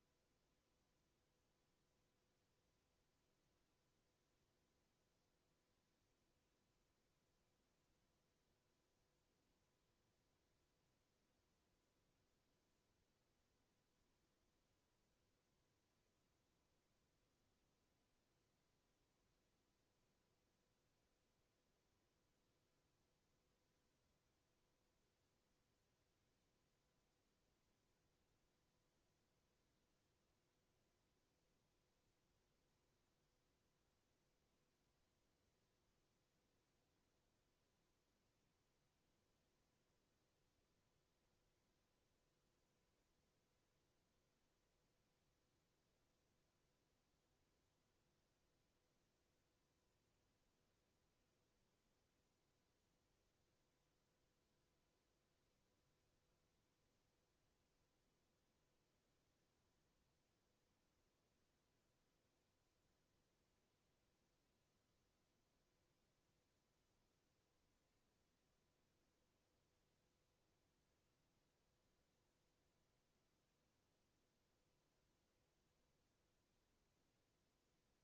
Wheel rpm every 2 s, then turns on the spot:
0, 0, 0, 0, 0, 0, 0, 0, 0, 0, 0, 0, 0, 0, 0, 0, 0, 0, 0, 0, 0, 0, 0, 0, 0, 0, 0, 0, 0, 0, 0, 0, 0, 0, 0, 0, 0, 0, 0.
none